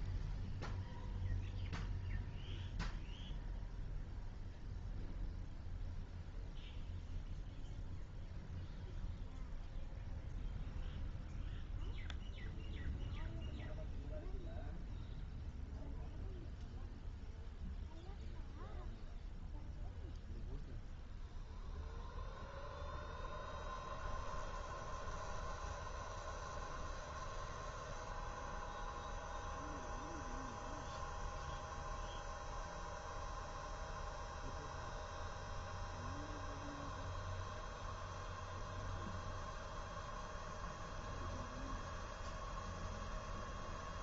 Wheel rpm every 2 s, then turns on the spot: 0, 0, 0, 0, 0, 0, 0, 0, 0, 0, 0, 0, 0, 0, 0, 0, 0, 0, 0, 0, 0, 0.
none